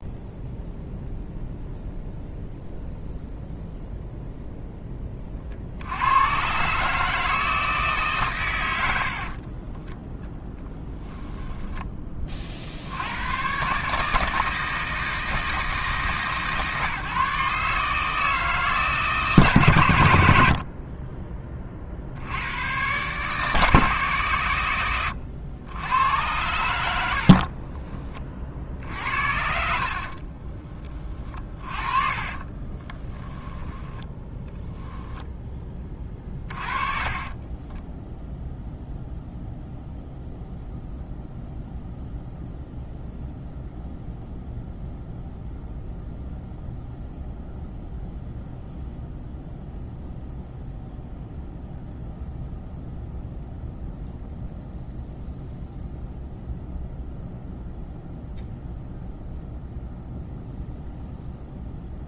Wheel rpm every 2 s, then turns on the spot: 0, 0, 20, 150, 80, 0, 80, 160, 150, 150, 30, 130, 100, 70, 50, 40, 20, 0, 30, 0, 0, 0, 0, 0, 0, 0, 0, 0, 0, 0, 0.
8-10 20-22 26-28 32-34 36-38